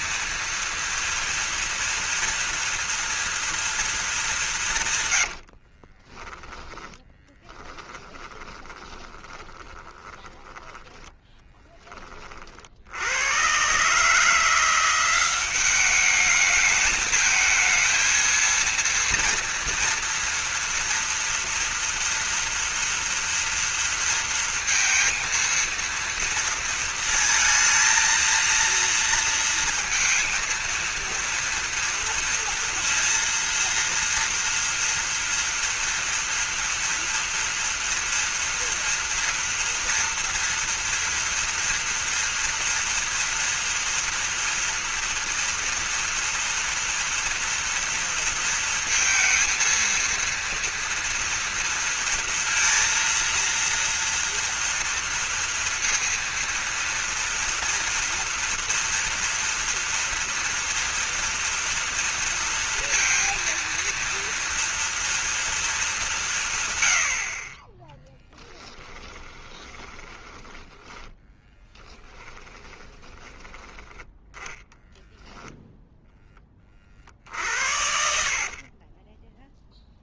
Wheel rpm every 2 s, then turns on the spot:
230, 240, 160, 10, 20, 10, 60, 180, 210, 230, 230, 230, 230, 230, 230, 230, 230, 230, 230, 230, 230, 240, 230, 230, 230, 230, 230, 230, 230, 230, 230, 230, 230, 110, 10, 10, 20, 10, 40, 40.
6-12 68-74